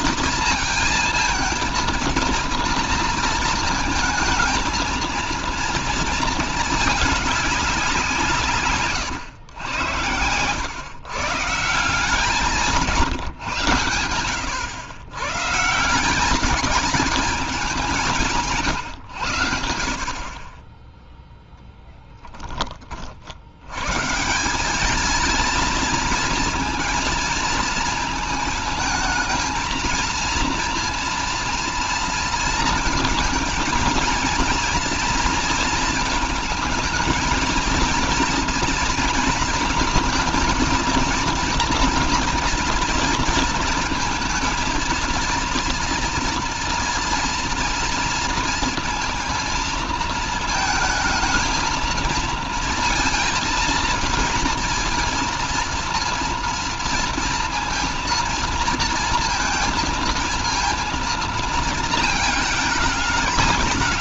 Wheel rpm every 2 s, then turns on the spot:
230, 220, 220, 210, 140, 130, 170, 110, 210, 130, 10, 30, 210, 230, 220, 230, 220, 230, 220, 230, 230, 230, 230, 230, 230, 230, 230, 230, 230, 230, 230, 220.
none